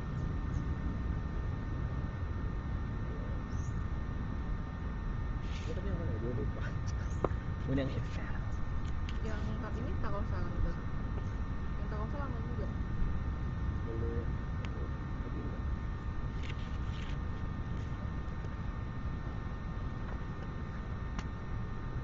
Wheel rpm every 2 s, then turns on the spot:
0, 0, 0, 0, 0, 0, 0, 0, 0, 0, 0.
none